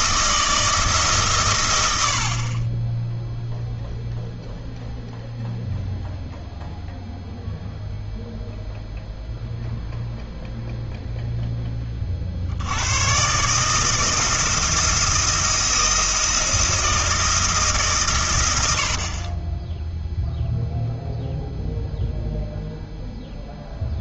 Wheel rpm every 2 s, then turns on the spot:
160, 20, 0, 0, 0, 0, 100, 160, 160, 70, 0, 0.
none